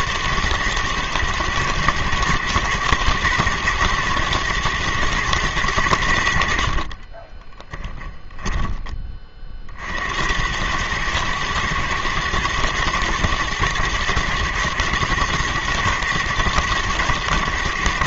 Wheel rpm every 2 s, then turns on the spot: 120, 120, 120, 40, 20, 110, 120, 120, 110.
6-8